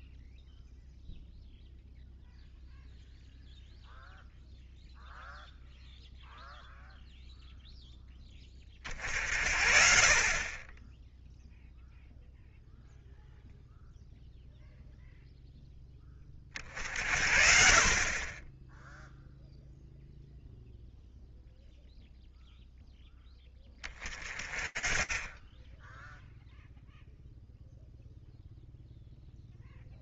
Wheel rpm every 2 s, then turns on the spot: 0, 0, 0, 0, 30, 10, 0, 0, 40, 10, 0, 0, 20, 0, 0.
none